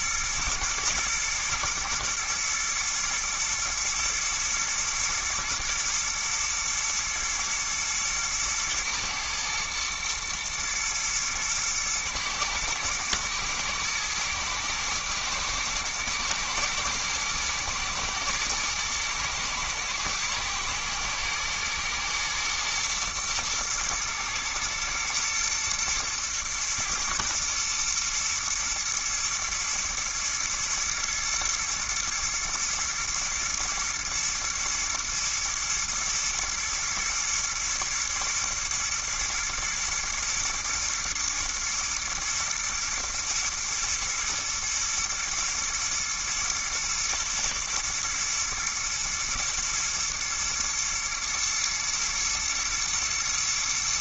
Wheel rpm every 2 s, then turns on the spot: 110, 110, 110, 120, 110, 110, 110, 110, 120, 120, 110, 110, 110, 110, 120, 120, 120, 110, 110, 120, 120, 120, 120, 110, 110, 110, 120.
none